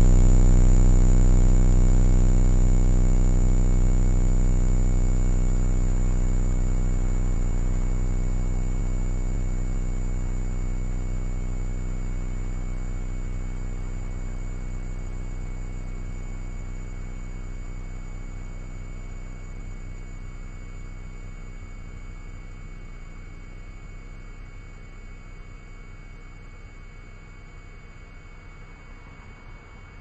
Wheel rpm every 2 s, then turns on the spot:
0, 0, 0, 0, 0, 0, 0, 0, 0, 0, 0, 0, 0, 0, 0.
none